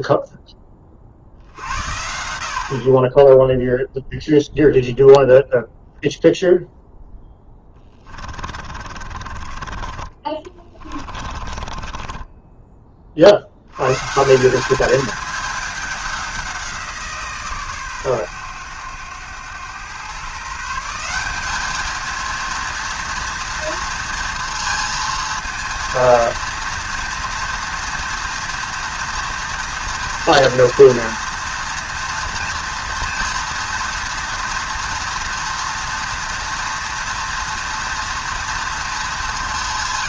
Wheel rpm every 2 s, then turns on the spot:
30, 40, 0, 0, 40, 40, 30, 210, 170, 100, 170, 230, 230, 230, 230, 230, 230, 230, 230, 220.
8-12